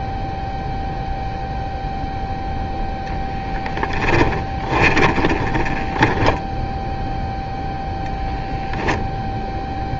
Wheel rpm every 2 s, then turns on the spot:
0, 0, 10, 0, 0.
4-6